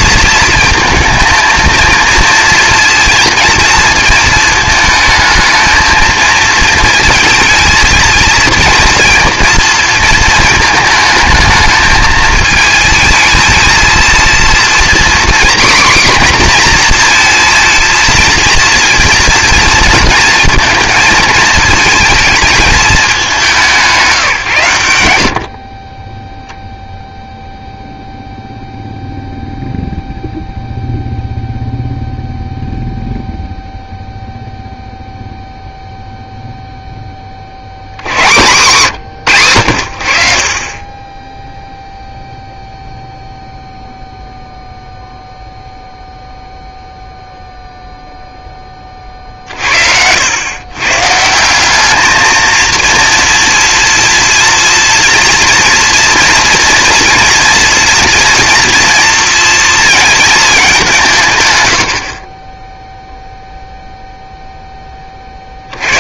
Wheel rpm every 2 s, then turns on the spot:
230, 230, 220, 230, 230, 220, 220, 240, 240, 230, 220, 210, 100, 0, 0, 0, 0, 0, 0, 140, 30, 0, 0, 0, 20, 120, 230, 230, 230, 230, 200, 10, 10.
none